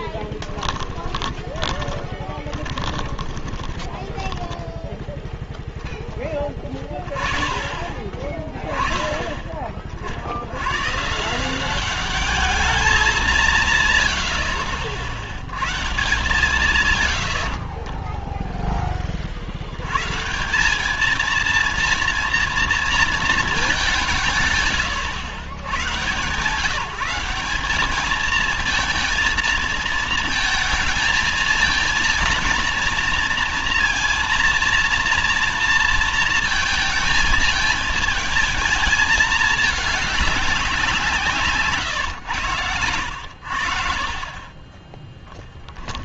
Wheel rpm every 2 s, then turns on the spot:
10, 20, 10, 20, 20, 70, 210, 60, 140, 10, 170, 230, 160, 140, 220, 220, 230, 230, 230, 220, 190, 100, 30.
0-6 18-20